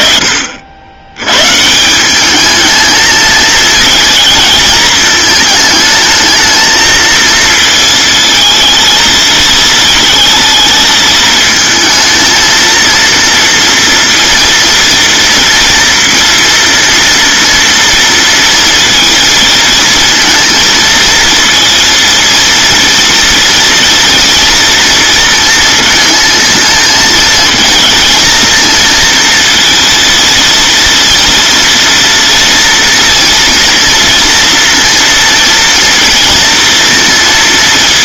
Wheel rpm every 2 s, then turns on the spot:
70, 220, 220, 220, 220, 220, 230, 230, 230, 230, 230, 230, 230, 220, 230, 230, 230, 230, 230.
none